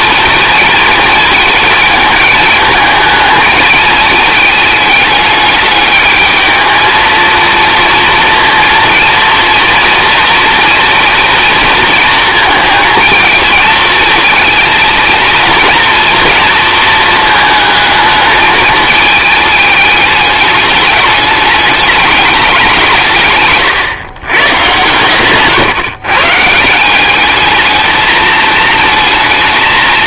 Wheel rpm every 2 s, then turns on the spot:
230, 220, 220, 220, 230, 230, 220, 230, 230, 220, 210, 190, 130, 160, 220.
none